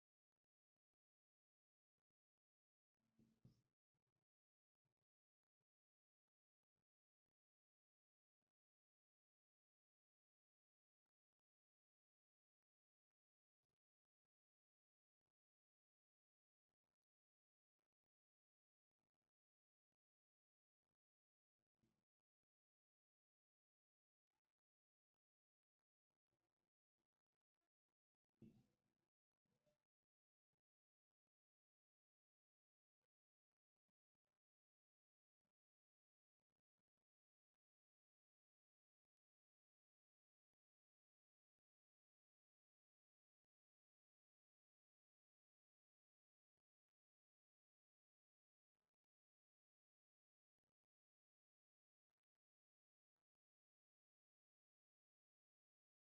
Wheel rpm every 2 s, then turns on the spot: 0, 0, 0, 0, 0, 0, 0, 0, 0, 0, 0, 0, 0, 0, 0, 0, 0, 0, 0, 0, 0, 0, 0, 0, 0, 0, 0, 0.
none